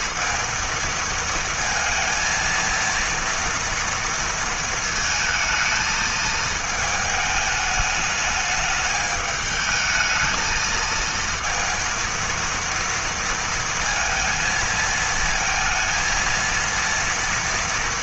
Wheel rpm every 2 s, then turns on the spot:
230, 230, 230, 210, 210, 230, 230, 230, 230.
none